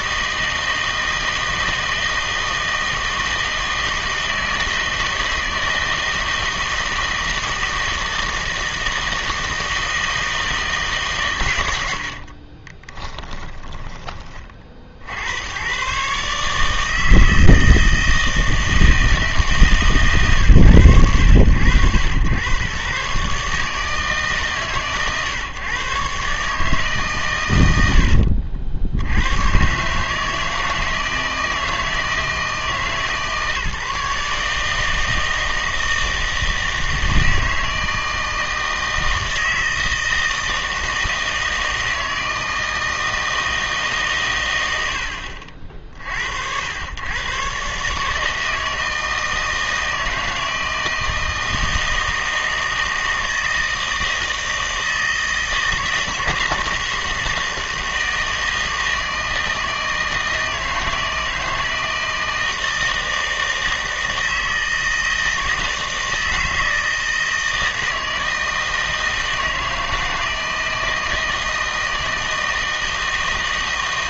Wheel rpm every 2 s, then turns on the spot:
160, 160, 160, 160, 160, 150, 30, 50, 160, 160, 100, 130, 130, 150, 70, 160, 160, 160, 160, 160, 160, 160, 90, 90, 160, 160, 160, 160, 160, 160, 160, 160, 160, 160, 160, 160, 160.
12-14